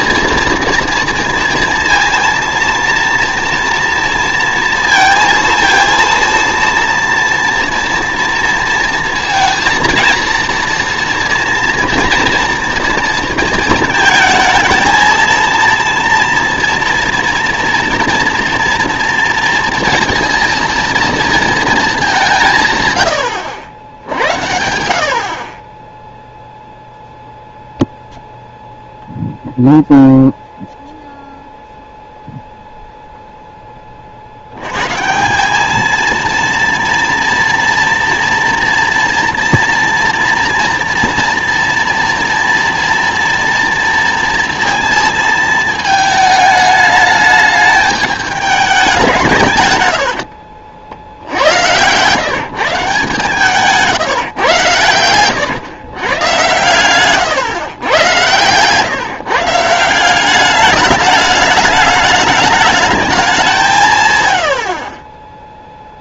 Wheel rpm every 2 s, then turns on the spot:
230, 230, 230, 230, 230, 230, 230, 220, 230, 230, 230, 130, 70, 0, 0, 0, 0, 100, 230, 230, 230, 230, 230, 220, 200, 60, 160, 120, 120, 140, 210, 210, 60.
56-58